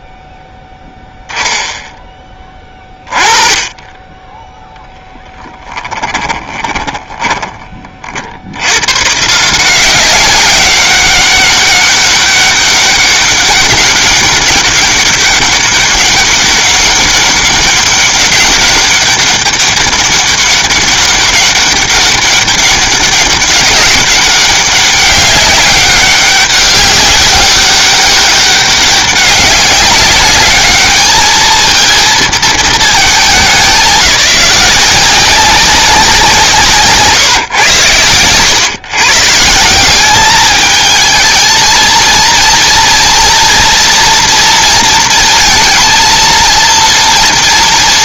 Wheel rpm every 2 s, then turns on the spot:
0, 20, 0, 10, 110, 200, 200, 200, 200, 200, 200, 200, 200, 200, 200, 210, 210, 170, 160, 130, 210, 230, 230, 230.
6-8